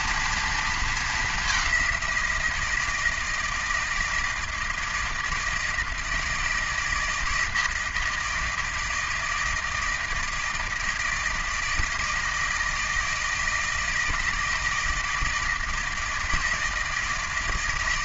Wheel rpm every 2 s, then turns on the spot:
230, 170, 160, 160, 160, 160, 160, 160, 160.
none